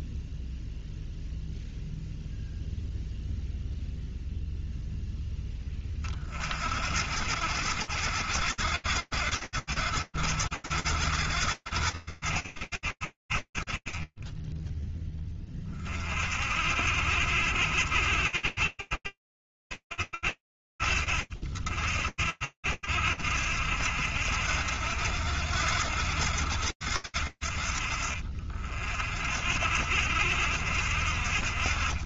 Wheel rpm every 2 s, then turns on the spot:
0, 0, 0, 60, 60, 70, 70, 30, 40, 70, 60, 50, 70, 70, 50, 60.
none